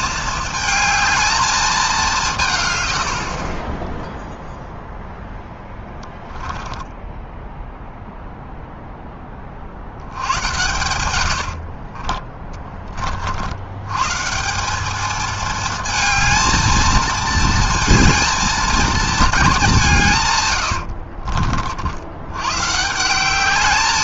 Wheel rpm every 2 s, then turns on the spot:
220, 70, 0, 10, 20, 90, 60, 220, 220, 220, 60, 190.
10-12 20-22